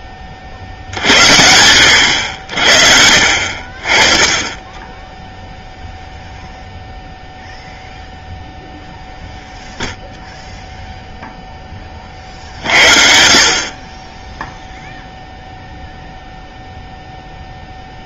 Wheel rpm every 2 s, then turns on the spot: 60, 60, 10, 0, 0, 0, 50, 0, 0.
none